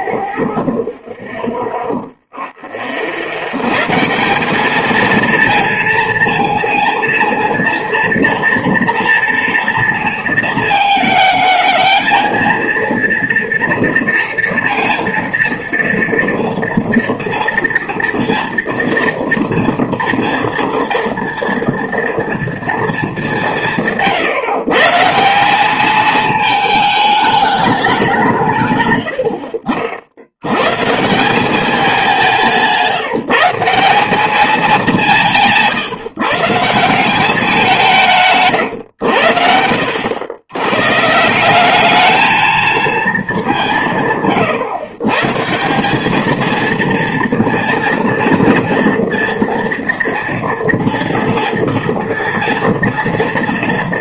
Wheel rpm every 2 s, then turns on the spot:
0, 20, 200, 230, 230, 220, 230, 230, 230, 230, 230, 230, 150, 210, 140, 120, 170, 190, 160, 130, 110, 220, 120, 230, 230, 230, 230.
32-34